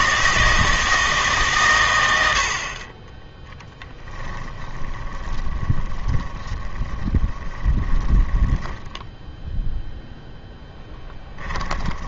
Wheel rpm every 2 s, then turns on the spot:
160, 50, 10, 20, 10, 10.
4-12